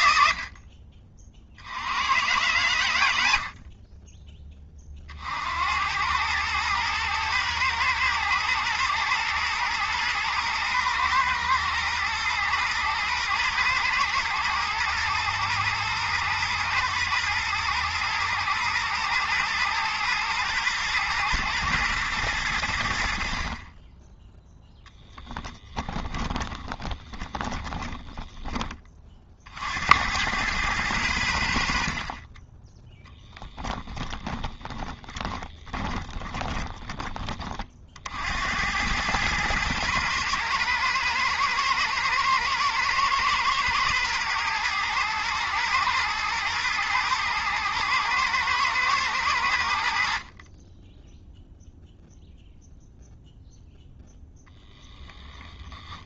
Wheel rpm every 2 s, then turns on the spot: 50, 110, 30, 110, 110, 110, 110, 110, 110, 110, 120, 70, 10, 20, 20, 100, 10, 20, 20, 100, 110, 110, 110, 110, 110, 20, 0, 10.
26-28 34-36 54-56